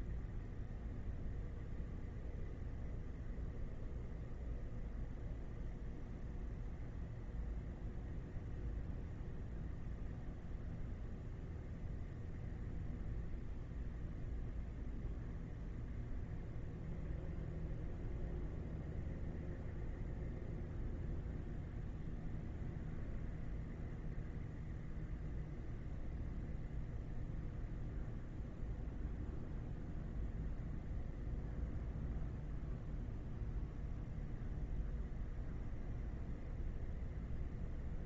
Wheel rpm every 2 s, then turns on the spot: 0, 0, 0, 0, 0, 0, 0, 0, 0, 0, 0, 0, 0, 0, 0, 0, 0, 0, 0.
none